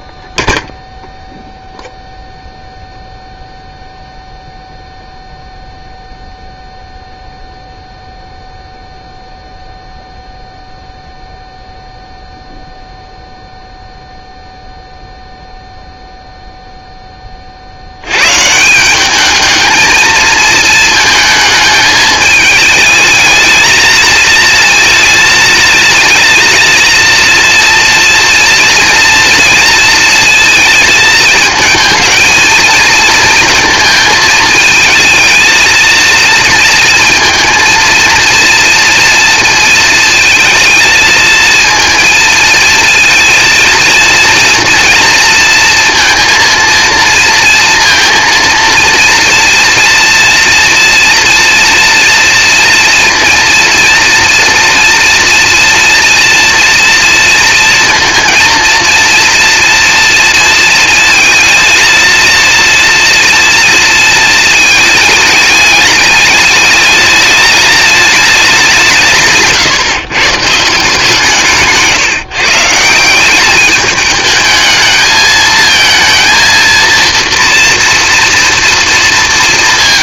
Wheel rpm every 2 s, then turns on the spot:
0, 0, 0, 0, 0, 0, 0, 0, 20, 200, 220, 220, 230, 230, 240, 220, 220, 220, 230, 230, 220, 230, 230, 230, 230, 230, 230, 240, 230, 230, 230, 240, 210, 210, 160, 160, 180, 220, 230, 230.
none